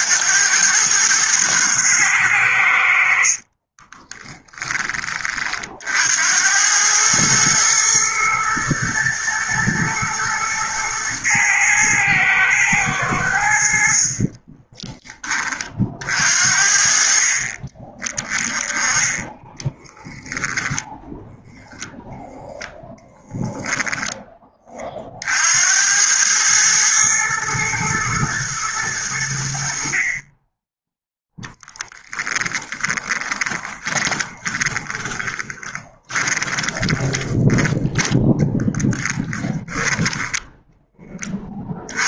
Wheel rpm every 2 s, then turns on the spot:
110, 60, 30, 110, 110, 110, 100, 20, 40, 10, 10, 0, 40, 110, 90, 0, 10, 20, 20, 20, 20.
2-4 32-40